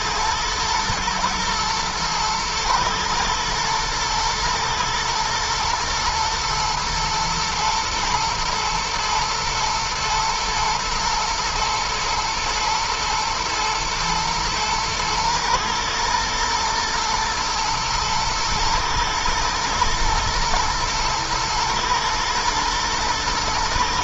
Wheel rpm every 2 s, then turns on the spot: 120, 110, 110, 110, 120, 110, 110, 110, 120, 110, 110, 110.
none